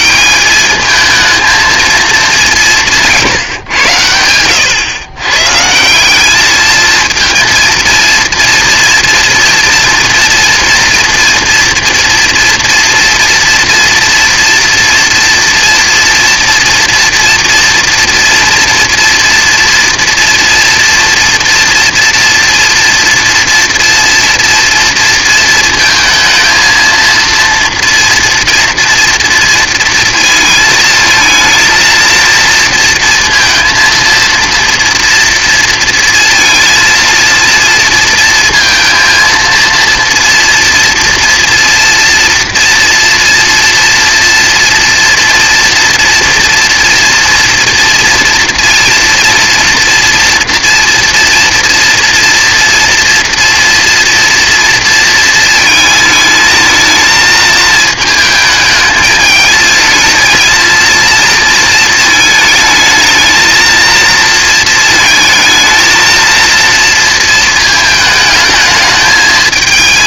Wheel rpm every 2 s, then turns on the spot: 200, 190, 110, 220, 230, 230, 240, 230, 240, 240, 240, 230, 230, 230, 230, 230, 230, 230, 230, 230, 240, 230, 230, 240, 240, 230, 230, 230, 220, 220, 230, 220, 230, 230, 220.
none